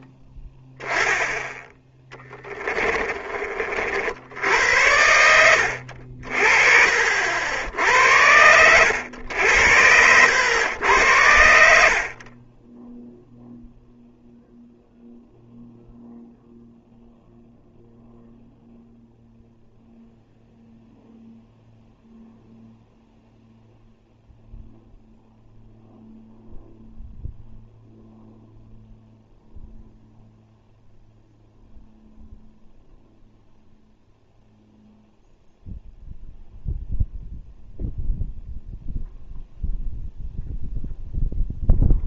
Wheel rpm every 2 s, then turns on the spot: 10, 20, 80, 50, 90, 100, 10, 0, 0, 0, 0, 0, 0, 0, 0, 0, 0, 0, 0, 0, 0.
2-4